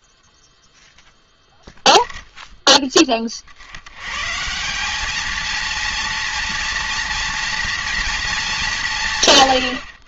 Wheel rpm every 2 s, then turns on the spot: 0, 110, 230, 240, 80.
none